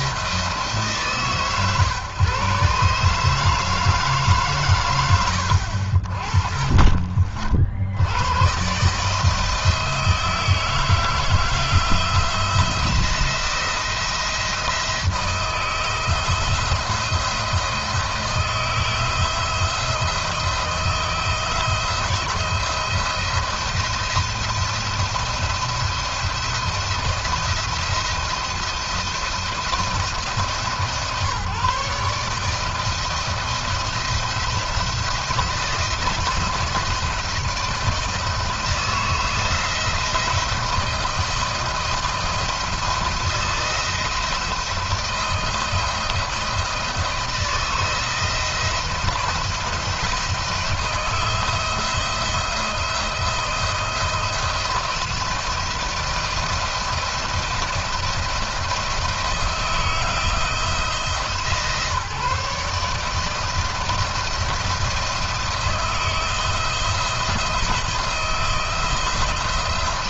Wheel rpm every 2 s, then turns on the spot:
140, 150, 80, 60, 160, 160, 170, 160, 170, 170, 160, 170, 160, 170, 170, 140, 170, 170, 160, 160, 160, 170, 170, 160, 170, 160, 170, 170, 170, 160, 150, 160, 170, 160, 160.
none